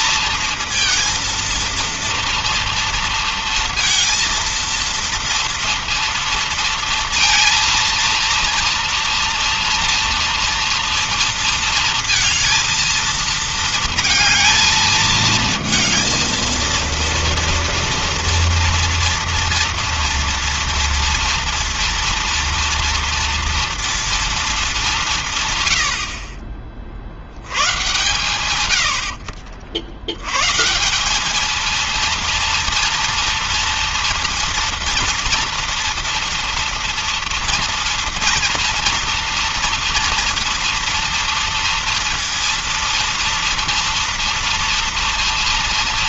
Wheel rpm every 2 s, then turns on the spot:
230, 230, 230, 230, 230, 230, 230, 220, 230, 230, 230, 230, 220, 40, 110, 130, 230, 230, 230, 230, 230, 230, 230.
none